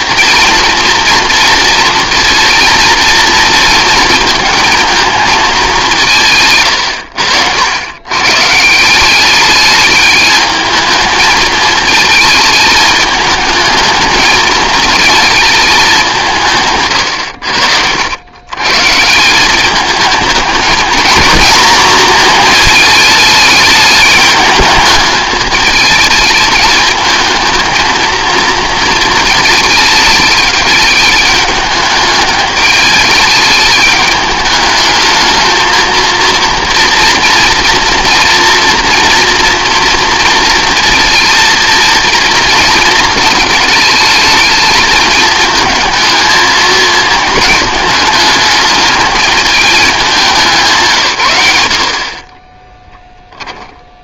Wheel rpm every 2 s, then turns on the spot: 230, 230, 230, 100, 170, 220, 220, 220, 130, 140, 220, 220, 210, 210, 230, 210, 210, 220, 240, 240, 230, 230, 220, 230, 220, 160, 10.
52-54